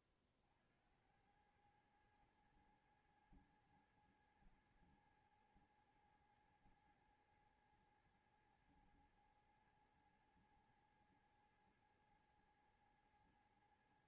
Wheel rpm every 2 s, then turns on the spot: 30, 110, 110, 110, 110, 110, 110.
none